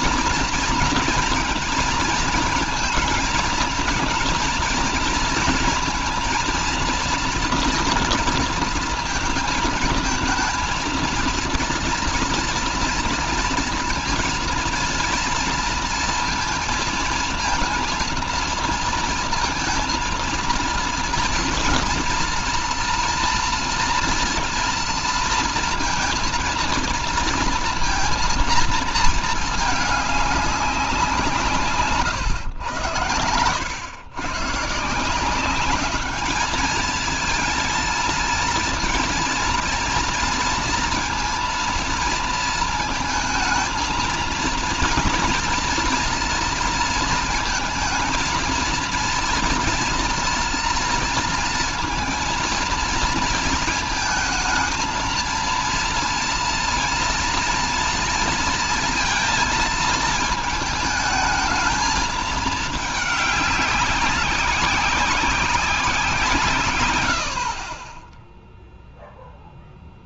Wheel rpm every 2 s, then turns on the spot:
230, 230, 230, 230, 230, 230, 230, 230, 230, 230, 230, 230, 230, 230, 230, 200, 120, 140, 220, 230, 230, 230, 230, 230, 230, 230, 230, 230, 230, 230, 220, 220, 190, 130, 0.
none